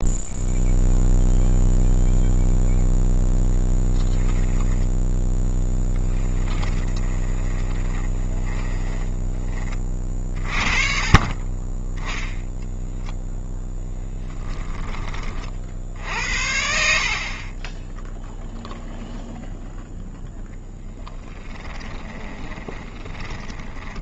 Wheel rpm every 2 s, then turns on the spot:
0, 0, 10, 20, 20, 40, 0, 10, 70, 0, 0, 20.
4-12 22-24